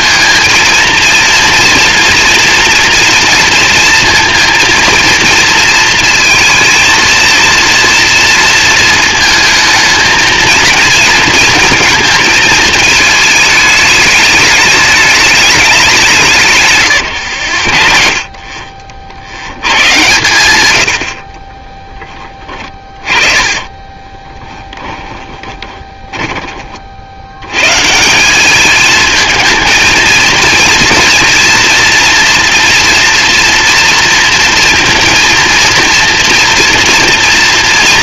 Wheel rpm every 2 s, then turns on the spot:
230, 230, 230, 220, 230, 230, 220, 210, 130, 40, 100, 20, 10, 30, 210, 230, 230, 230, 230.
16-18 22-26